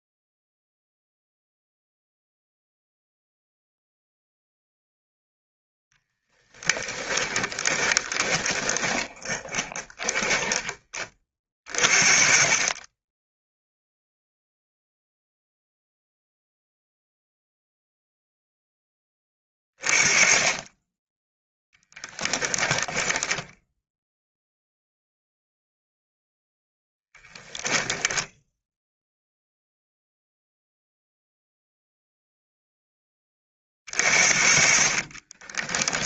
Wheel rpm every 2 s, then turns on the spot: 0, 0, 0, 0, 20, 10, 30, 0, 0, 10, 20, 20, 0, 10, 0, 0, 10, 40.
8-12 22-24 26-28 34-36